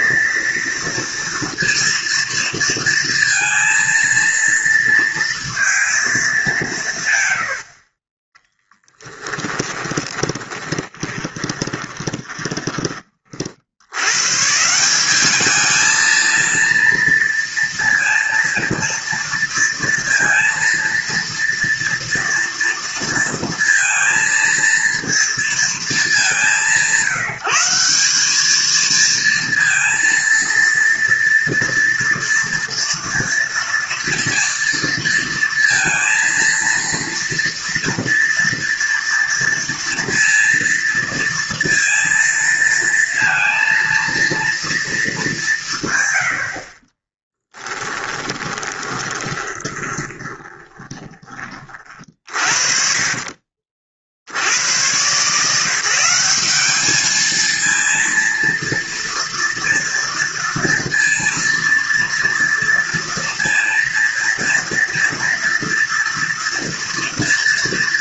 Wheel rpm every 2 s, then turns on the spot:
230, 230, 230, 170, 10, 20, 20, 170, 230, 230, 230, 230, 230, 160, 220, 230, 230, 230, 230, 230, 230, 230, 230, 40, 20, 20, 40, 110, 210, 230, 230, 230, 230, 230.
8-12 48-52